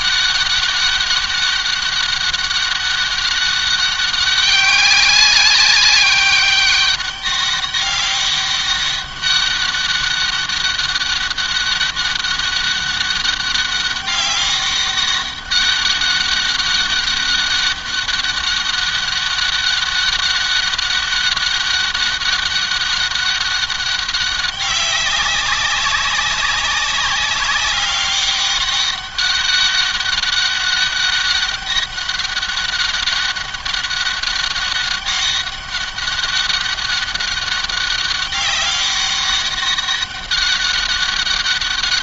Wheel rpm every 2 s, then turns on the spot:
200, 200, 200, 200, 200, 200, 200, 200, 200, 190, 200, 200, 190, 200, 200, 200, 200, 200, 200, 190, 200.
none